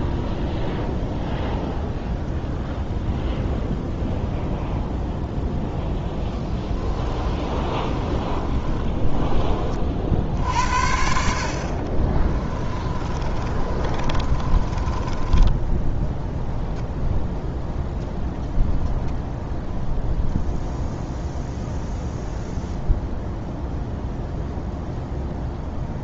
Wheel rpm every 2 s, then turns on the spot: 0, 0, 0, 20, 20, 60, 30, 30, 0, 0, 0, 0, 0.
6-10 12-16